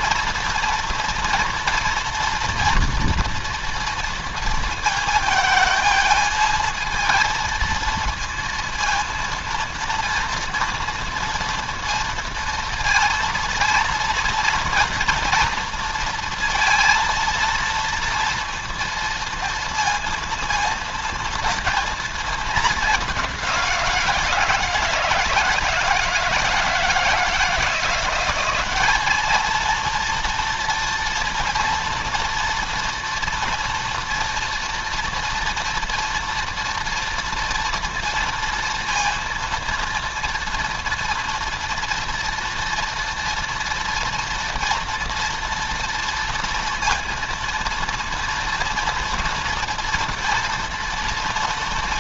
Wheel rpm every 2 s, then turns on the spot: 240, 240, 220, 220, 230, 230, 230, 230, 230, 230, 230, 210, 170, 160, 200, 230, 230, 230, 240, 230, 230, 230, 230, 230, 230, 230.
none